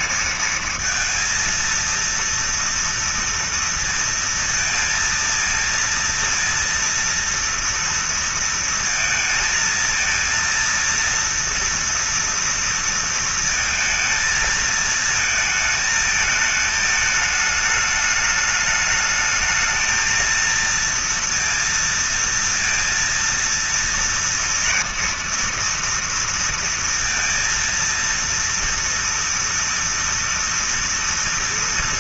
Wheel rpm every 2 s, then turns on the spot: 220, 230, 230, 230, 230, 230, 240, 230, 220, 210, 220, 230, 230, 230, 230, 230.
none